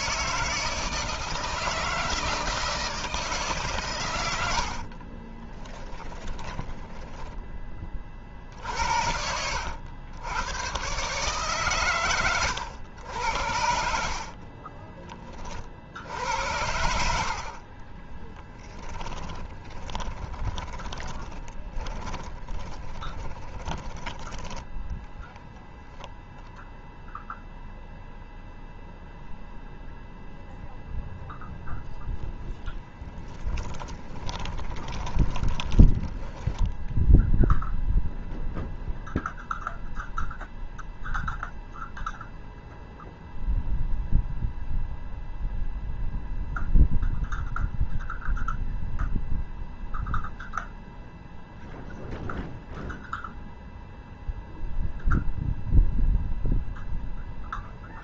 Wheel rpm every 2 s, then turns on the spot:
160, 160, 60, 20, 70, 130, 110, 40, 80, 10, 20, 20, 10, 0, 0, 0, 10, 20, 0, 0, 0, 0, 0, 0, 0, 0, 0, 0, 0.
4-8 14-26 32-36